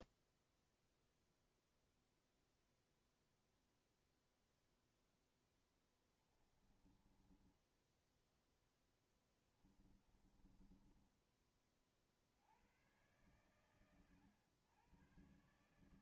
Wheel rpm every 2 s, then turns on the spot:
0, 0, 0, 20, 10, 20, 60, 110.
6-12